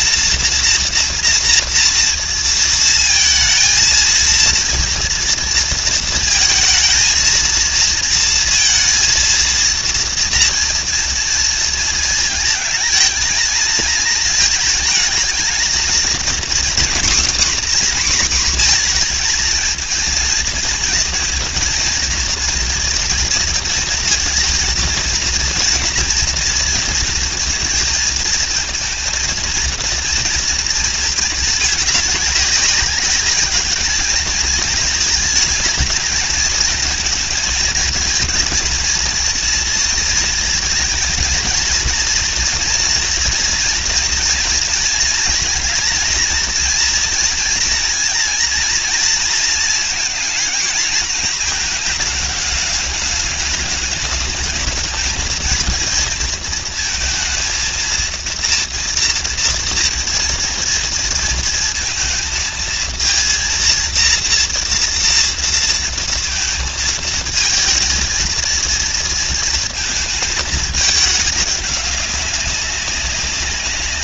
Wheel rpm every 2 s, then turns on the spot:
230, 230, 230, 220, 230, 230, 220, 220, 260, 230, 230, 230, 230, 230, 230, 220, 200, 220, 220, 230, 230, 230, 220, 230, 230, 220, 210, 220, 230, 230, 230, 230, 230, 220, 230, 220, 180.
none